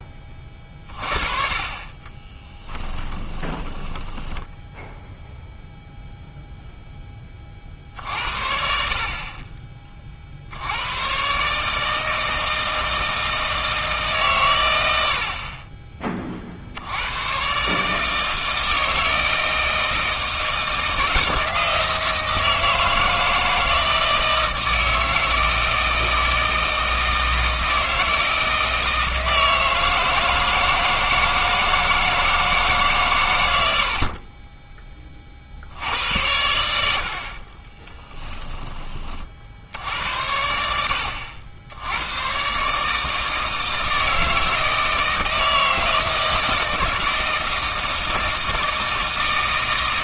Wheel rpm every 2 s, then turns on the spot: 30, 20, 10, 0, 50, 90, 160, 110, 70, 160, 160, 160, 160, 160, 160, 160, 150, 20, 80, 20, 80, 140, 160, 160, 160.
2-6